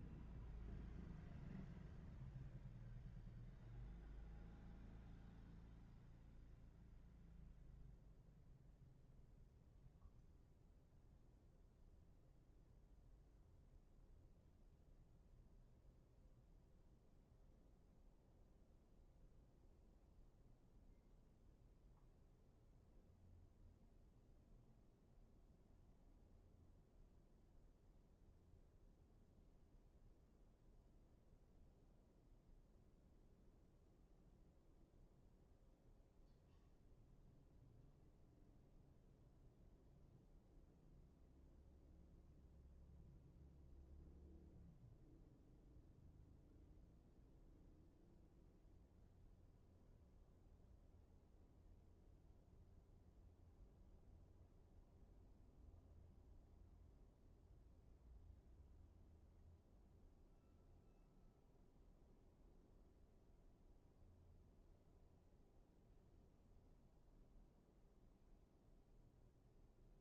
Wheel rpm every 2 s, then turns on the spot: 0, 0, 0, 0, 0, 0, 0, 0, 0, 0, 0, 0, 0, 0, 0, 0, 0, 0, 0, 0, 0, 0, 0, 0, 0, 0, 0, 0, 0, 0, 0, 0, 0, 0, 0.
none